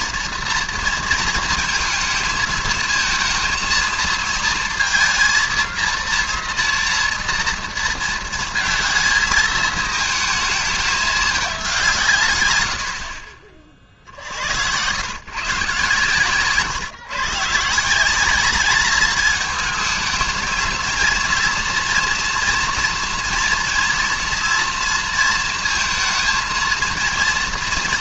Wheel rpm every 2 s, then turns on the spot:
230, 220, 230, 230, 220, 210, 80, 100, 130, 210, 220, 230, 230, 230.
none